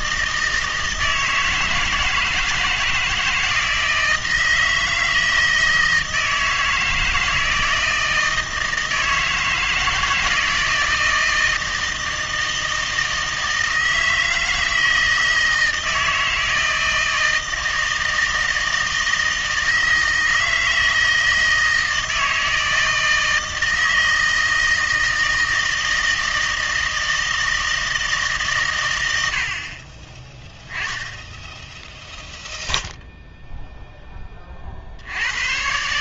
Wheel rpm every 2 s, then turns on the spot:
160, 160, 160, 160, 160, 160, 160, 160, 160, 160, 160, 160, 160, 160, 120, 10, 0, 50.
none